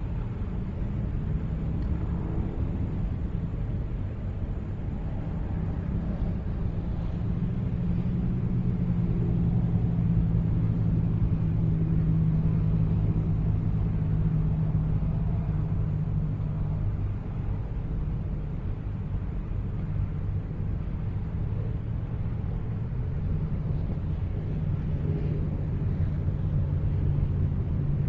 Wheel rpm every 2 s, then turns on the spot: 0, 0, 0, 0, 0, 0, 0, 0, 0, 0, 0, 0, 0, 0.
none